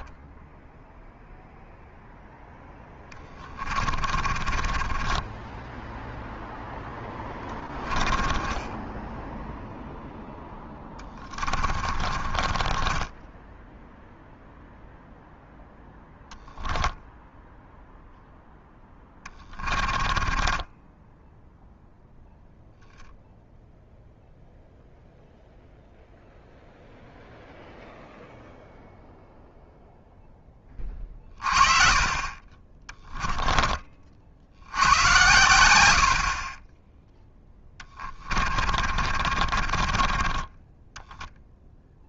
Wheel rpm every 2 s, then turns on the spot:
0, 0, 30, 10, 10, 10, 20, 0, 0, 10, 10, 0, 0, 0, 0, 30, 20, 90, 10, 40, 10.
4-6 8-14 18-22 32-34 38-40